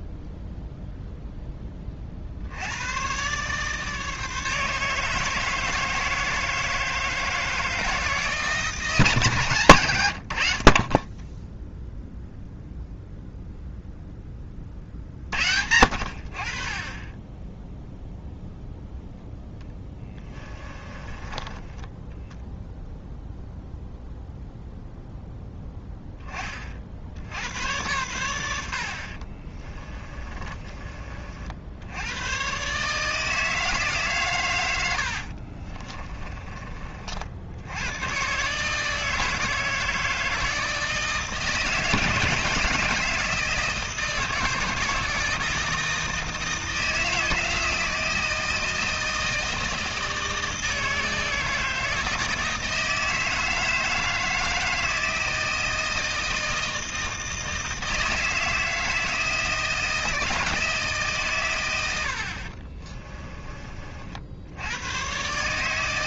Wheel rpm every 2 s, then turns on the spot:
0, 100, 160, 160, 150, 40, 0, 30, 40, 0, 20, 0, 0, 60, 60, 30, 130, 100, 40, 160, 160, 160, 160, 160, 160, 160, 160, 160, 160, 160, 160, 30, 110.
20-22 30-32 34-36 62-64